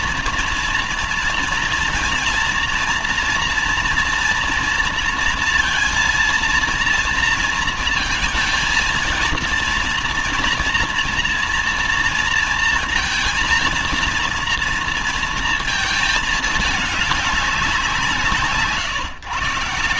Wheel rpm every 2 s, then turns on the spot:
230, 230, 230, 230, 220, 230, 230, 230, 210, 160.
none